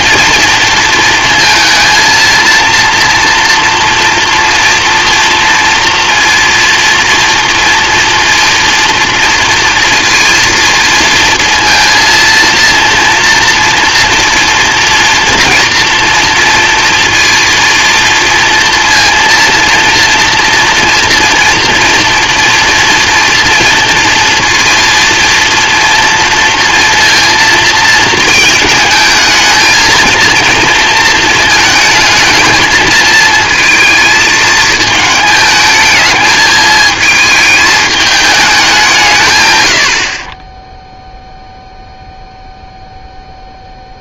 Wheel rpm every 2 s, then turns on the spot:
230, 230, 230, 230, 230, 230, 230, 230, 230, 230, 240, 230, 230, 230, 220, 220, 220, 220, 220, 180, 0, 0.
none